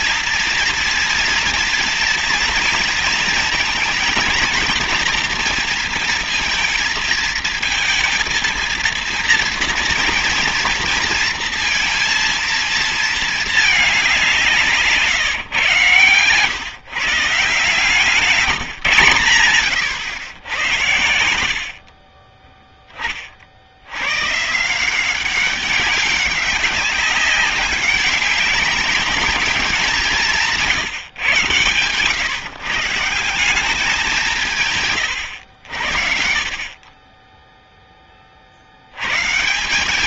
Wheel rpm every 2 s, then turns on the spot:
230, 230, 230, 230, 230, 230, 230, 180, 130, 170, 110, 30, 150, 200, 200, 160, 140, 170, 40, 40.
none